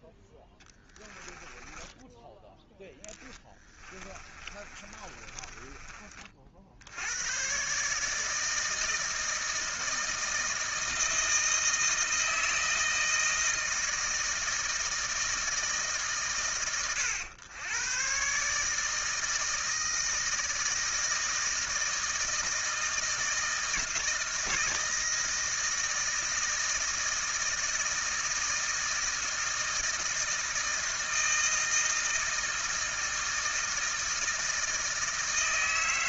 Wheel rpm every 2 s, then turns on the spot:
10, 10, 30, 60, 160, 160, 160, 160, 100, 150, 160, 160, 160, 160, 160, 160, 160, 160.
0-6